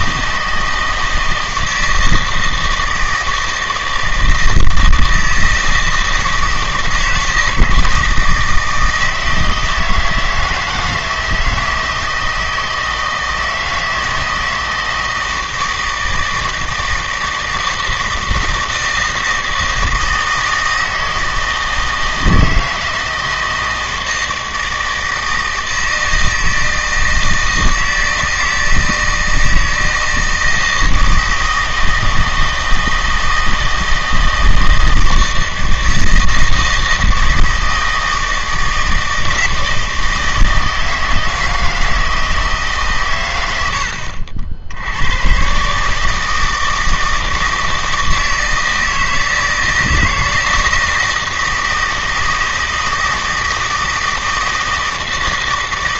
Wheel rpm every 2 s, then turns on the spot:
160, 160, 160, 160, 160, 160, 160, 160, 160, 160, 160, 160, 160, 160, 160, 160, 160, 160, 160, 160, 160, 150, 70, 160, 160, 160, 160, 160.
none